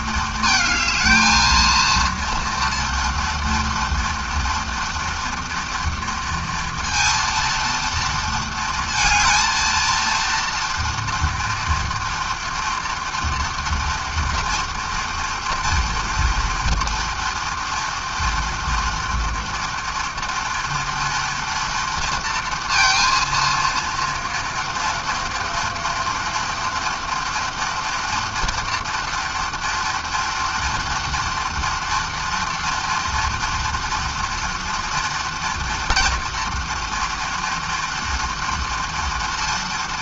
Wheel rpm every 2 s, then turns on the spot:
220, 230, 230, 230, 230, 230, 230, 230, 230, 230, 230, 230, 230, 240, 230, 230, 240, 230, 240, 230.
none